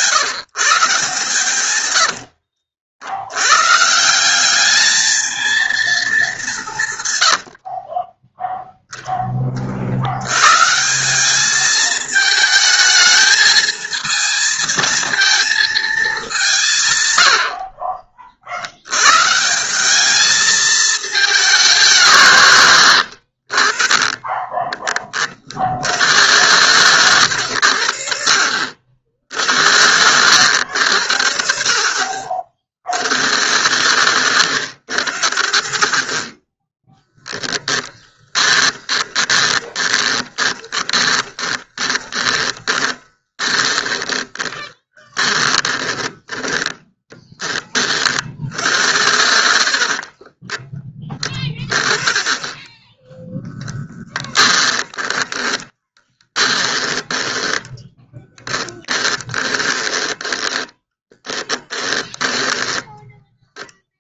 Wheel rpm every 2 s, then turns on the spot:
160, 60, 210, 140, 0, 150, 220, 220, 160, 100, 220, 110, 20, 110, 60, 90, 50, 60, 10, 30, 20, 20, 20, 20, 80, 20, 10, 20, 40, 20, 20, 10.
22-24 28-30 38-48 54-64